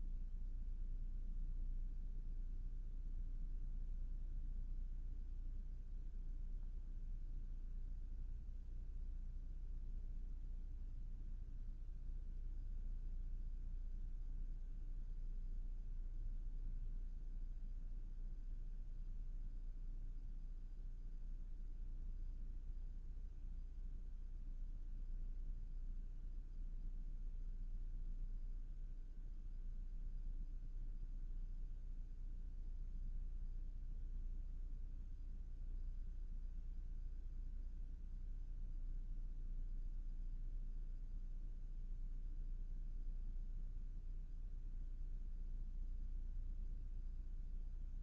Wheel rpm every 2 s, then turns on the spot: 0, 0, 0, 0, 0, 0, 0, 0, 0, 0, 0, 0, 0, 0, 0, 0, 0, 0, 0, 0, 0, 0, 0, 0.
none